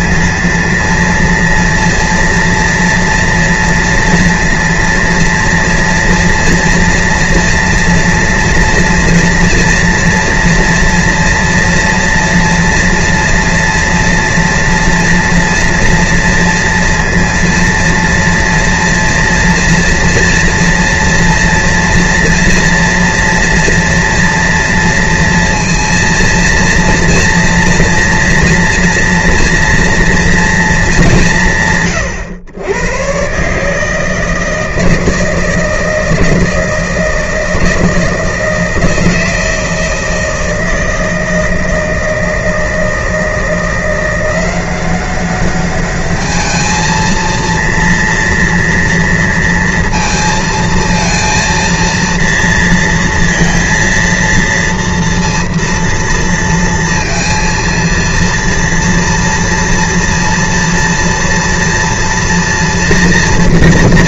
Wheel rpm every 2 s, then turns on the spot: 230, 230, 230, 230, 230, 230, 230, 230, 230, 230, 230, 230, 230, 230, 230, 230, 100, 160, 160, 160, 160, 160, 180, 210, 230, 230, 230, 230, 230, 230, 230, 230.
none